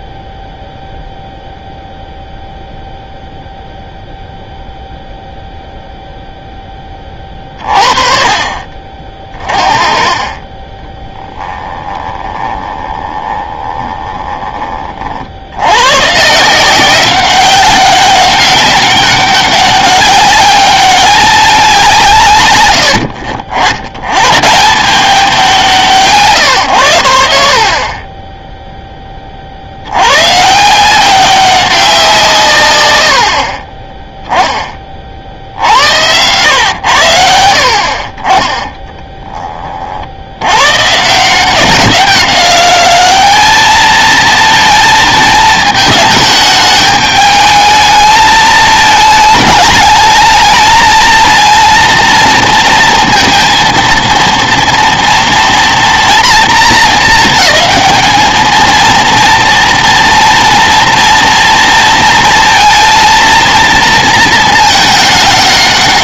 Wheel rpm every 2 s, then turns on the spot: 0, 0, 0, 10, 40, 20, 20, 30, 170, 200, 200, 100, 130, 120, 10, 160, 140, 20, 110, 10, 120, 200, 230, 220, 220, 220, 230, 230, 230, 220, 230, 230, 220.
10-14 38-40